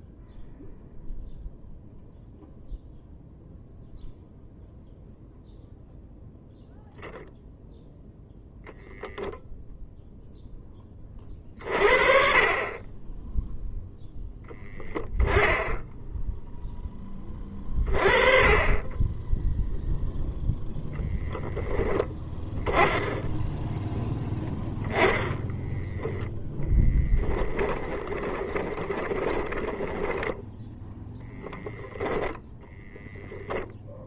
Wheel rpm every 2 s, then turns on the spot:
0, 0, 0, 0, 0, 10, 30, 10, 10, 20, 0, 20, 0, 10, 20, 10, 10.
14-16 28-30 32-34